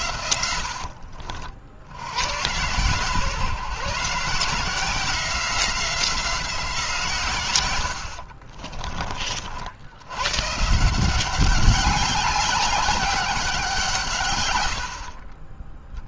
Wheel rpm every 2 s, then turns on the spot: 60, 120, 170, 150, 30, 160, 200, 60.
0-2 14-16